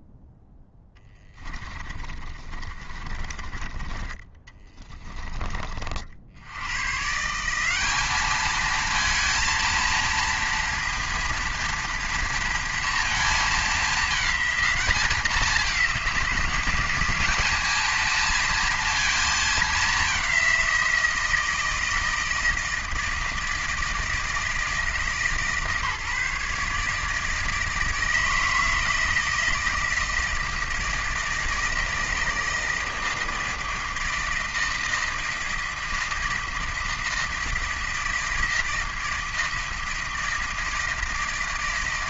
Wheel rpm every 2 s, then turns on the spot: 10, 30, 20, 90, 220, 230, 230, 210, 180, 230, 180, 160, 160, 150, 160, 160, 160, 160, 160, 160, 160.
2-6